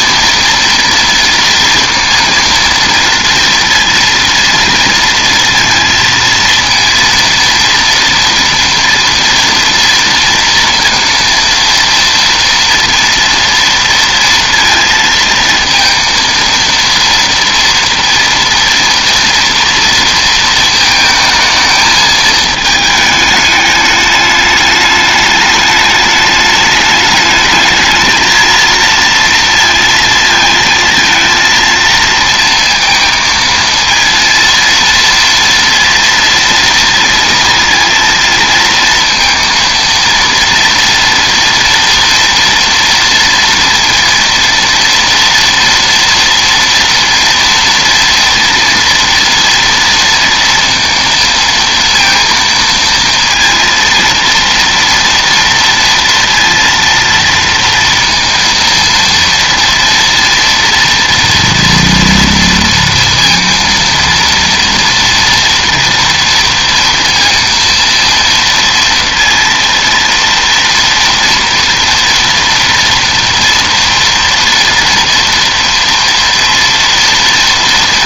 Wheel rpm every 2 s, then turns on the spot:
230, 230, 230, 230, 230, 230, 230, 230, 230, 230, 220, 220, 210, 210, 230, 220, 230, 230, 230, 230, 230, 240, 230, 230, 230, 230, 230, 230, 230, 230, 230, 230, 230, 230, 230, 230, 230, 230, 230.
none